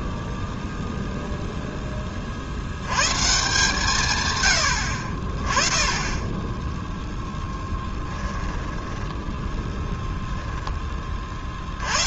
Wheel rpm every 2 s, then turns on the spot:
0, 100, 80, 0, 10, 10.
8-10